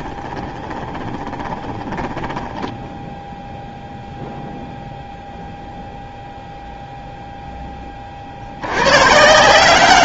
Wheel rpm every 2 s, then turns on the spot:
20, 0, 0, 0, 110.
0-2